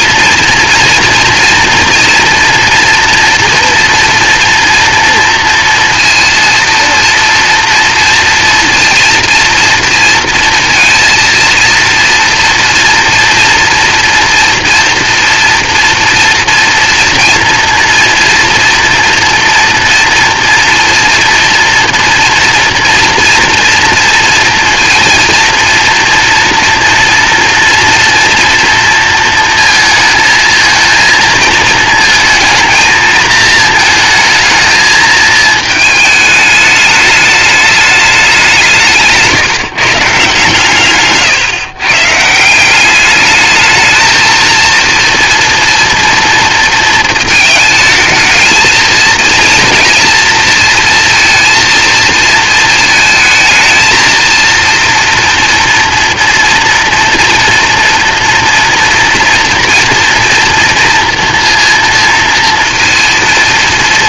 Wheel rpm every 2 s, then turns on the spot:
240, 230, 230, 230, 230, 230, 240, 240, 230, 230, 230, 230, 230, 230, 230, 220, 230, 220, 210, 160, 140, 190, 230, 220, 220, 220, 220, 230, 230, 230, 230, 230.
none